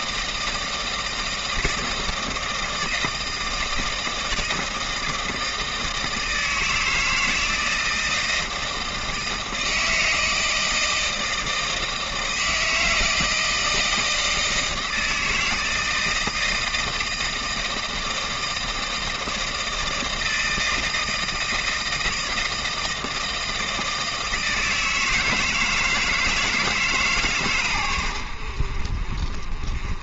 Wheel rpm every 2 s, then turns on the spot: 160, 160, 160, 160, 160, 160, 160, 160, 160, 160, 160, 160, 160, 150, 60.
none